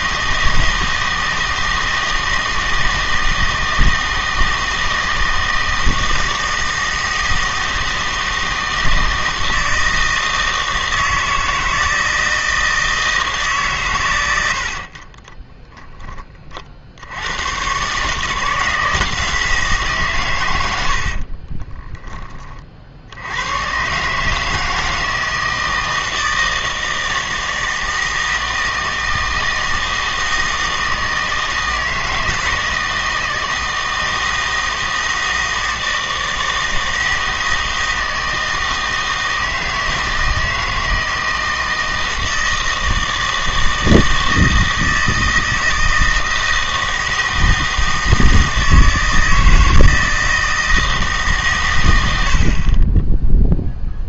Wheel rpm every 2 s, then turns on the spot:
160, 160, 160, 160, 160, 160, 160, 60, 60, 160, 90, 50, 160, 160, 160, 160, 160, 160, 160, 160, 160, 160, 160, 160, 160, 160, 40.
none